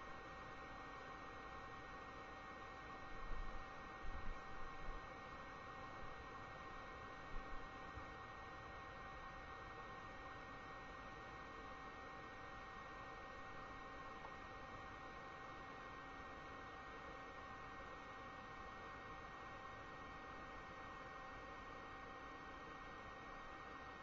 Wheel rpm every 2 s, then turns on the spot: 0, 0, 0, 0, 0, 0, 0, 0, 0, 0, 0, 0.
none